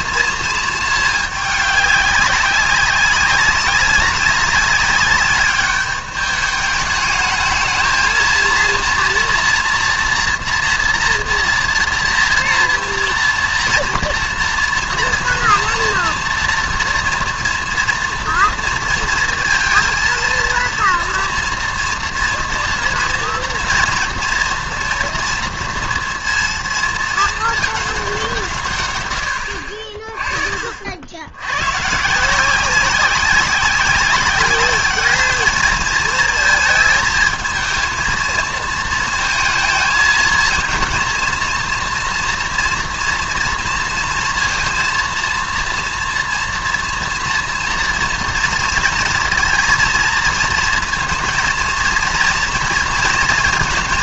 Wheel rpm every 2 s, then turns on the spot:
220, 190, 200, 210, 230, 240, 230, 230, 230, 230, 230, 230, 230, 230, 150, 50, 180, 200, 220, 220, 220, 230, 230, 230, 230, 230, 230.
none